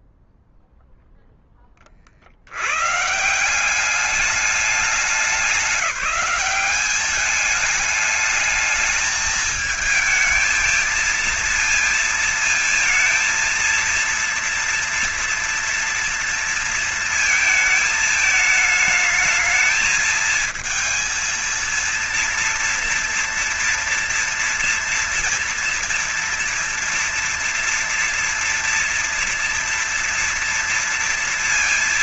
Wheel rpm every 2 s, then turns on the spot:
0, 110, 200, 190, 220, 220, 220, 230, 230, 220, 220, 230, 230, 230, 230, 230.
none